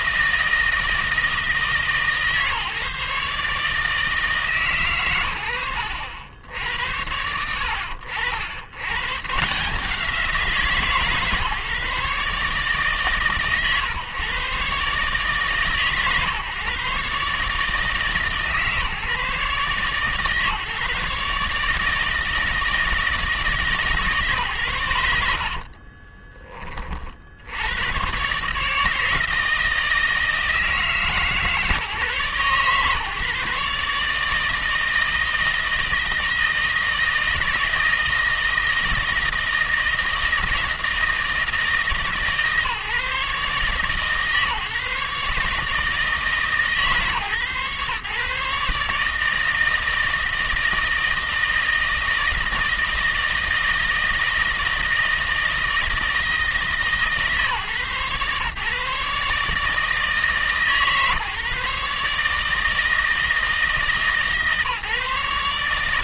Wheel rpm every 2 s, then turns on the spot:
160, 150, 120, 80, 110, 160, 140, 140, 140, 150, 150, 160, 100, 30, 150, 160, 140, 160, 160, 160, 160, 150, 140, 150, 150, 160, 160, 160, 150, 140, 140, 160, 150.
none